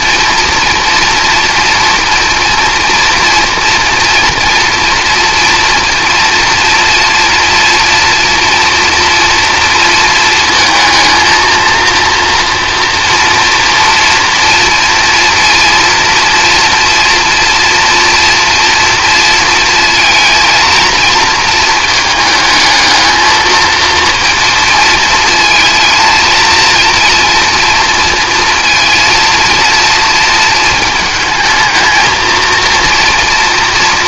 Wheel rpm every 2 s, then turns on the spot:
240, 230, 230, 240, 230, 230, 240, 240, 240, 230, 230, 220, 230, 230, 230, 220, 240.
none